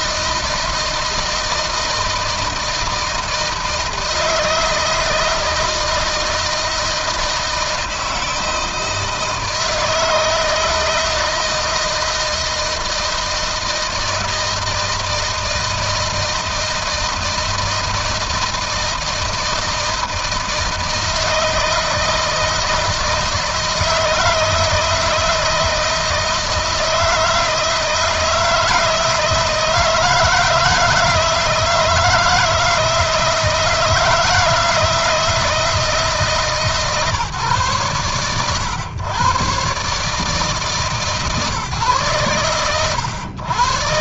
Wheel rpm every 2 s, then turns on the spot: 160, 160, 160, 160, 160, 160, 160, 160, 160, 160, 160, 160, 160, 160, 160, 160, 160, 170, 150, 120, 140, 100.
none